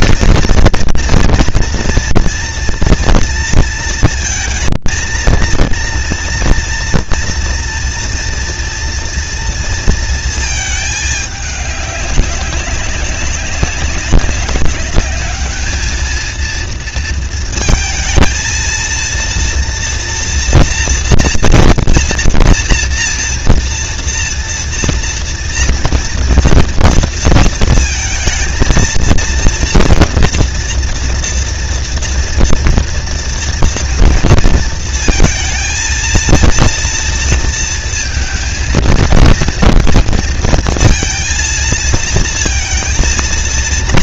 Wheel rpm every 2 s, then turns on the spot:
230, 230, 230, 240, 240, 210, 190, 200, 230, 230, 240, 240, 230, 230, 230, 230, 230, 220, 230, 230, 230, 230.
none